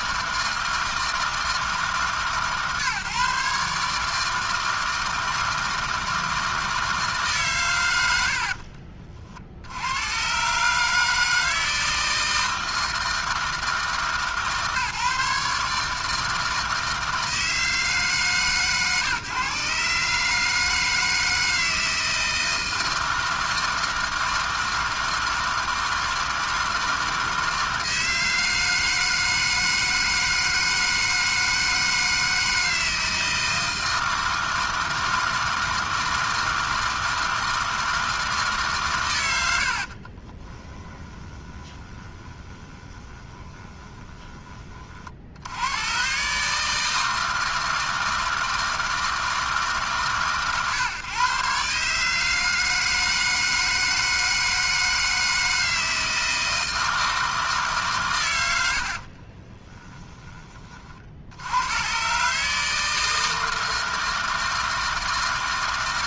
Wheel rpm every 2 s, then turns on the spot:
160, 140, 160, 160, 40, 150, 160, 150, 160, 140, 160, 160, 160, 160, 160, 160, 160, 160, 160, 140, 20, 20, 30, 150, 160, 130, 160, 160, 160, 70, 30, 150, 160.
40-44